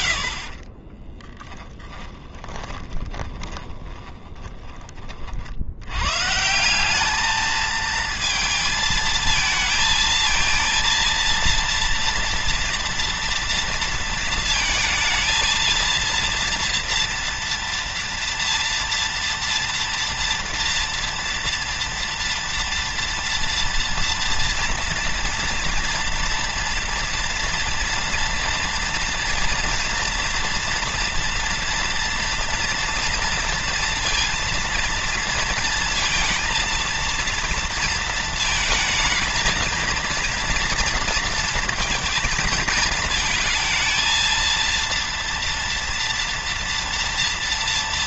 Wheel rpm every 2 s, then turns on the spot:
30, 30, 20, 180, 220, 230, 230, 230, 230, 230, 230, 230, 230, 230, 230, 230, 230, 230, 230, 220, 230, 220, 230, 240.
0-4